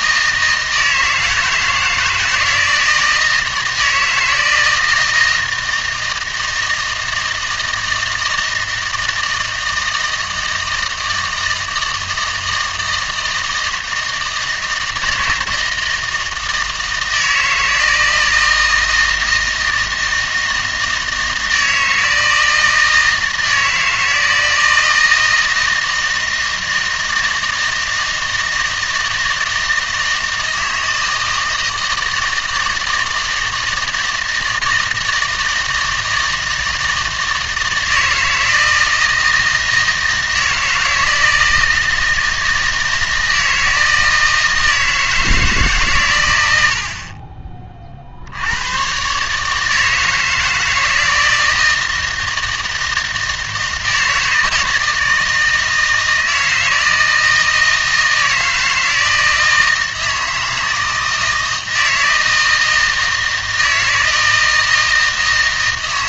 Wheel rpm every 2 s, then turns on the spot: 160, 160, 160, 160, 160, 160, 160, 160, 160, 160, 160, 160, 160, 160, 160, 160, 160, 160, 160, 160, 160, 160, 160, 80, 90, 160, 160, 160, 160, 160, 160, 160, 160.
none